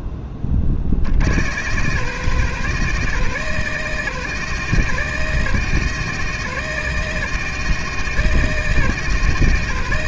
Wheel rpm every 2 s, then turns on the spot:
30, 130, 130, 130, 130.
none